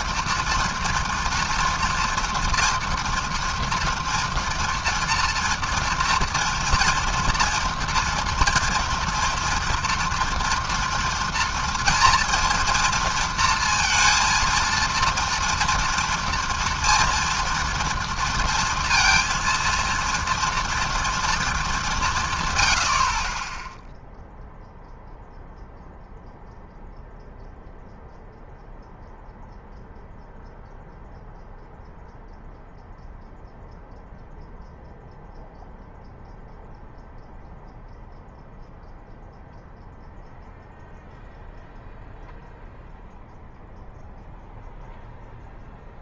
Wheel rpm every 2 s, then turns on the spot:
240, 240, 230, 230, 230, 230, 230, 230, 230, 230, 230, 100, 0, 0, 0, 0, 0, 0, 0, 0, 0, 0, 0.
none